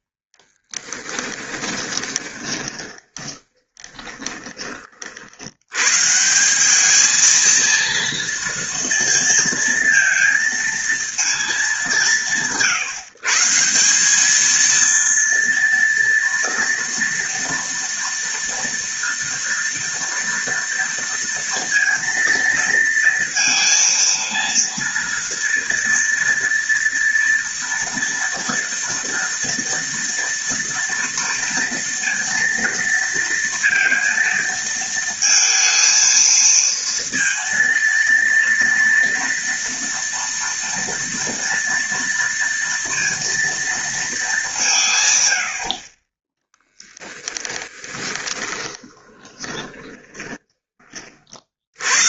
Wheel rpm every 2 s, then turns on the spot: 20, 20, 70, 220, 230, 220, 140, 230, 230, 230, 230, 230, 230, 230, 230, 230, 230, 230, 230, 230, 230, 230, 100, 10, 20, 50.
0-4 46-50